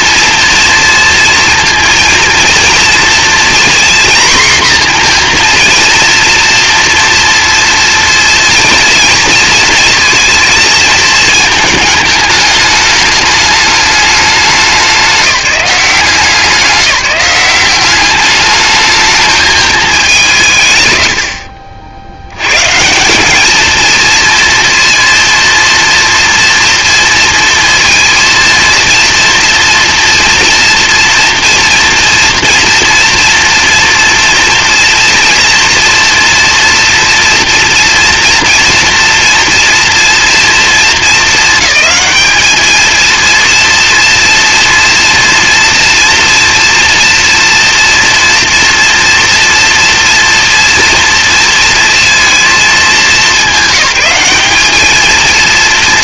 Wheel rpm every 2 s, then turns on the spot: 230, 230, 240, 230, 230, 220, 210, 190, 190, 210, 130, 140, 230, 230, 230, 230, 230, 230, 230, 240, 230, 220, 230, 230, 230, 230, 220, 210.
none